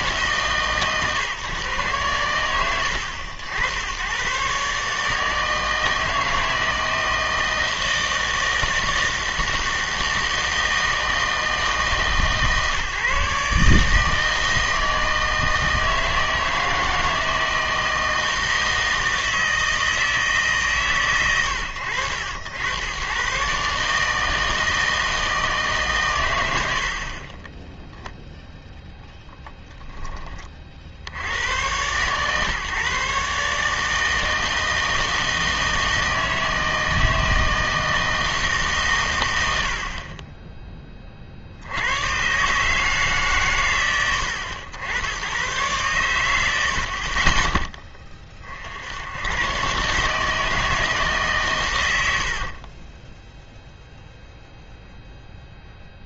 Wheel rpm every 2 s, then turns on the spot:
130, 90, 140, 160, 160, 160, 140, 160, 160, 160, 140, 100, 160, 80, 0, 40, 140, 160, 160, 150, 20, 150, 80, 70, 70, 160, 40, 0.
52-54